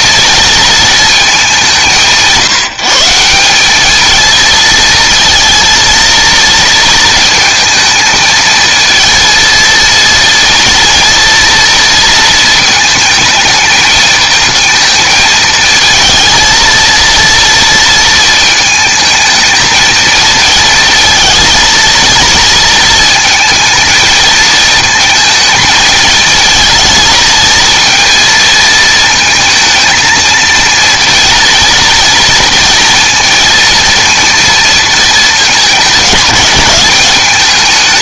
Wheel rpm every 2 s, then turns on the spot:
220, 170, 230, 230, 230, 240, 220, 220, 230, 220, 220, 230, 230, 220, 230, 230, 230, 230, 200.
none